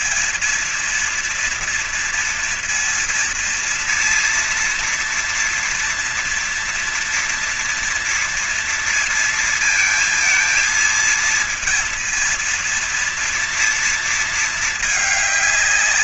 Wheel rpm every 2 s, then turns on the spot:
230, 230, 240, 240, 230, 220, 230, 220.
none